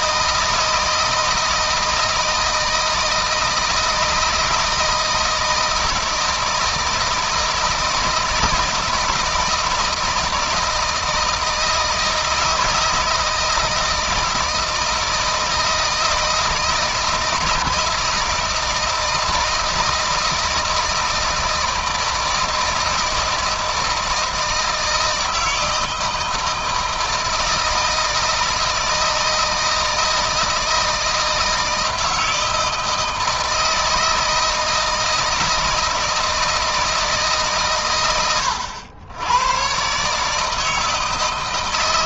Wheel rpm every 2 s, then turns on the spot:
160, 160, 160, 170, 170, 160, 160, 160, 160, 160, 160, 160, 160, 160, 160, 160, 160, 160, 160, 100, 160.
none